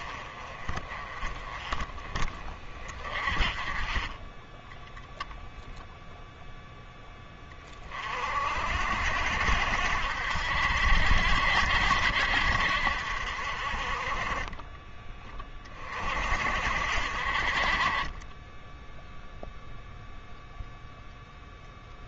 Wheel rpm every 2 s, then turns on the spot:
30, 30, 10, 10, 60, 60, 60, 20, 50, 0, 0.
none